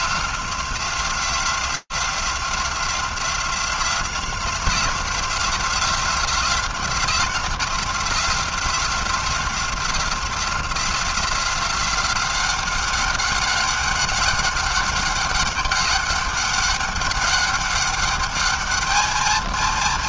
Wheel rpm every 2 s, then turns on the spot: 180, 180, 180, 180, 180, 180, 190, 200, 200, 210.
none